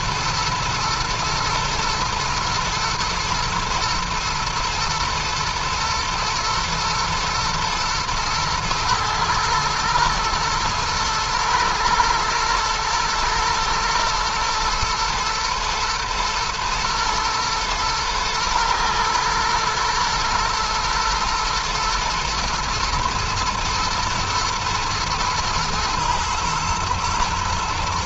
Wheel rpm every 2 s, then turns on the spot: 110, 110, 110, 120, 110, 120, 110, 110, 110, 110, 110, 120, 110, 110.
none